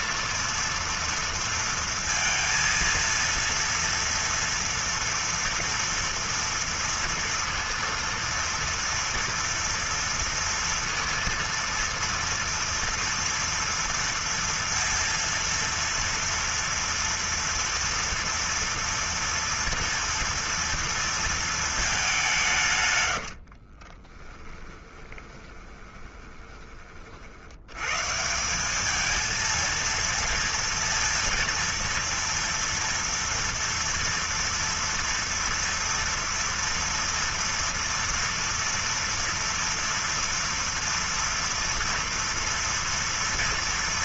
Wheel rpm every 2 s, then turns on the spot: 230, 230, 230, 230, 230, 230, 230, 230, 230, 230, 230, 180, 20, 20, 170, 230, 230, 230, 230, 230, 230, 230.
24-28